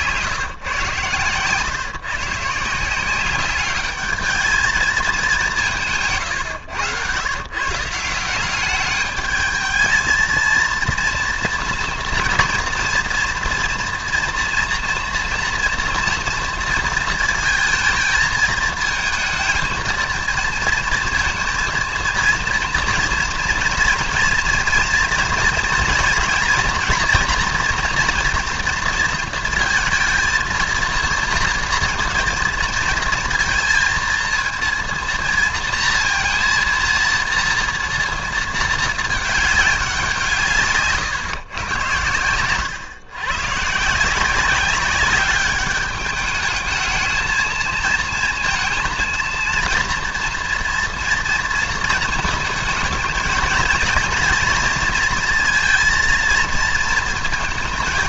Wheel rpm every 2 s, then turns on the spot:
140, 150, 220, 120, 190, 230, 230, 230, 230, 220, 230, 230, 230, 240, 240, 220, 230, 230, 230, 220, 150, 120, 190, 210, 230, 230, 220, 230, 230.
none